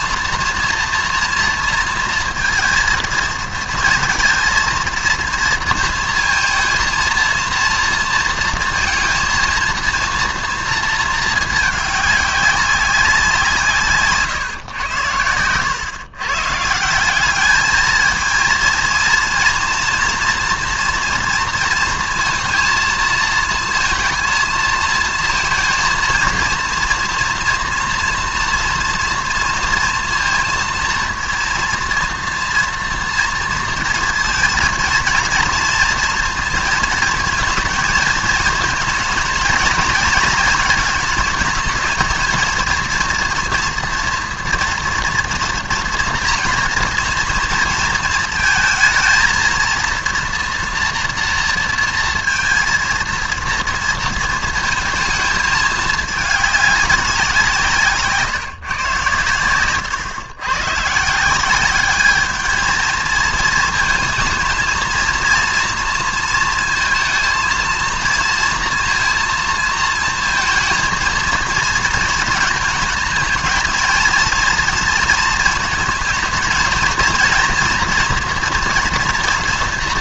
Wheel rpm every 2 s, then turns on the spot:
230, 230, 230, 230, 230, 220, 190, 110, 170, 230, 230, 220, 230, 230, 230, 230, 230, 230, 230, 230, 220, 230, 240, 230, 220, 230, 230, 220, 200, 130, 150, 220, 230, 230, 230, 230, 220, 230, 220, 230.
none